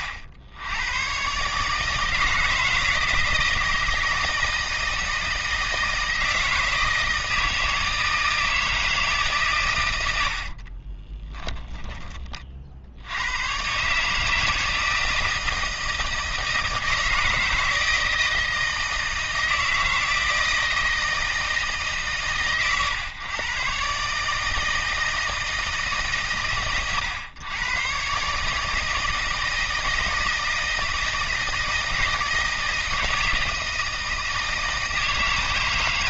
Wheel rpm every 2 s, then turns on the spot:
90, 160, 160, 160, 160, 40, 50, 160, 160, 160, 160, 110, 160, 110, 150, 160, 160, 160.
10-12